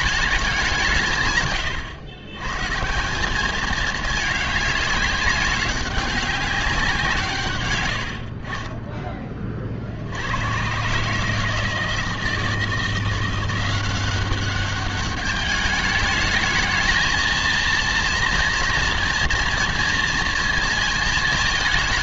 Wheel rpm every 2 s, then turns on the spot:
190, 130, 210, 190, 40, 110, 160, 200, 210, 230, 230.
none